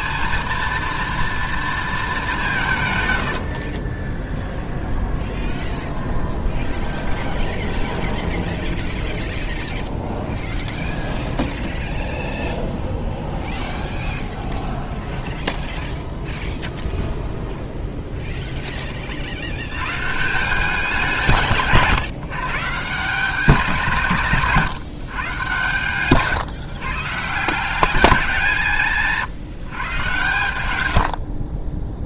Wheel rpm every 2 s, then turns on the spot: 230, 160, 20, 10, 0, 10, 20, 0, 10, 20, 190, 150, 150, 140, 170, 90.
4-8 10-14